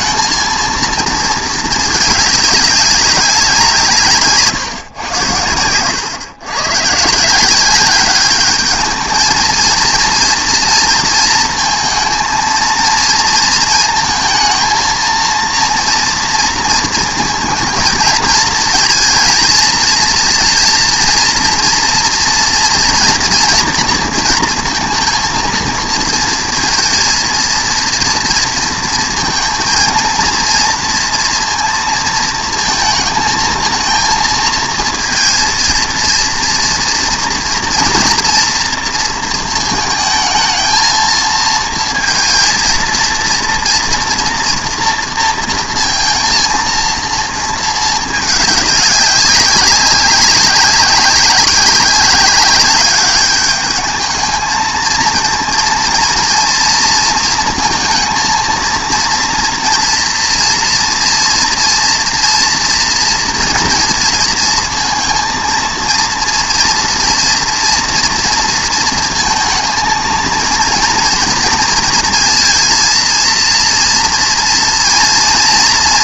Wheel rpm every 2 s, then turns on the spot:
220, 200, 130, 130, 220, 230, 220, 220, 220, 220, 230, 240, 230, 230, 230, 230, 230, 230, 230, 230, 220, 230, 230, 230, 200, 190, 200, 220, 230, 230, 230, 230, 230, 240, 230, 230, 230, 230.
none